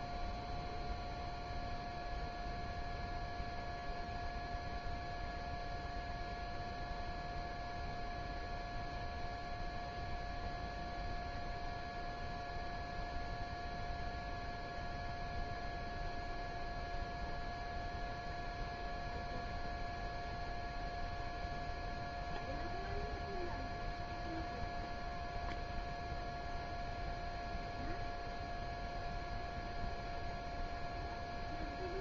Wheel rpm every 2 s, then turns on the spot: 0, 0, 0, 0, 0, 0, 0, 0, 0, 0, 0, 0, 0, 0, 0, 0.
none